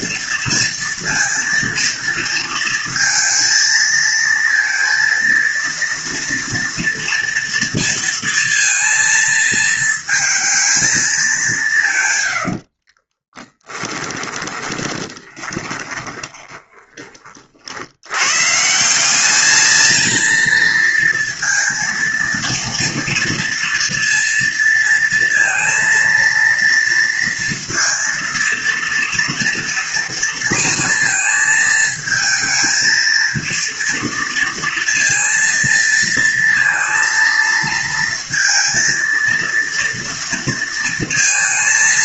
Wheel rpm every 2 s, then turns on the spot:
230, 230, 230, 230, 230, 220, 60, 20, 20, 160, 230, 230, 230, 230, 230, 230, 220, 230, 230, 230, 230.
12-18